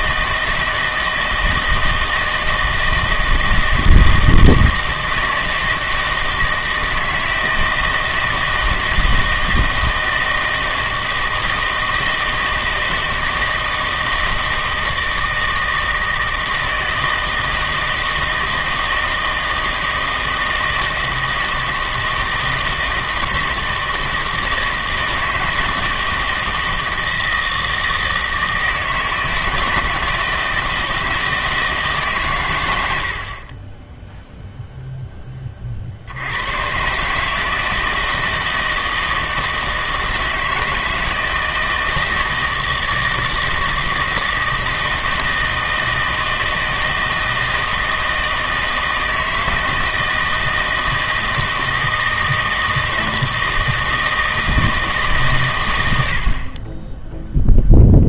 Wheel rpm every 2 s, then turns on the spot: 160, 160, 160, 160, 160, 160, 160, 160, 160, 160, 160, 160, 160, 160, 160, 160, 90, 0, 120, 160, 160, 160, 160, 160, 160, 160, 160, 160, 20.
none